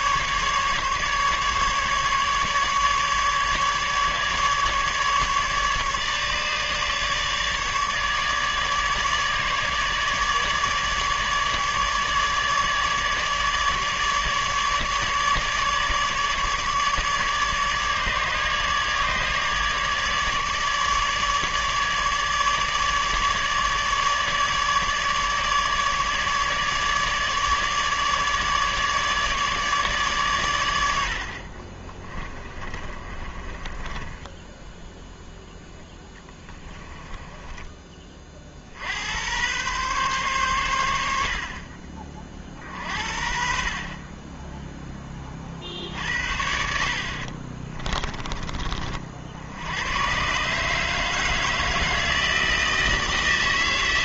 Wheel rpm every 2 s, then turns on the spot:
150, 150, 150, 150, 150, 150, 150, 150, 150, 150, 150, 150, 150, 150, 150, 90, 30, 10, 20, 60, 110, 50, 10, 60, 40, 150, 160.
32-38